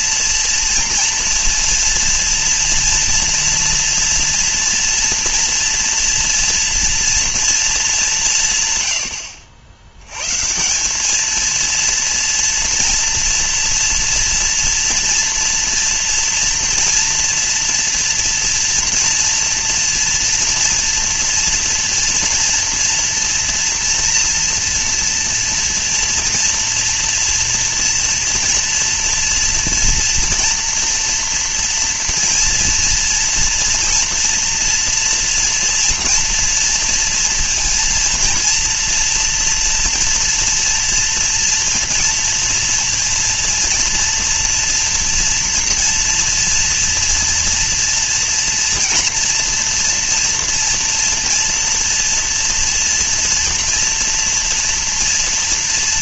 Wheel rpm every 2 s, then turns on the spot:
230, 230, 230, 230, 100, 190, 230, 230, 230, 230, 230, 230, 230, 230, 230, 240, 230, 230, 230, 230, 230, 230, 230, 230, 230, 230, 230, 240.
none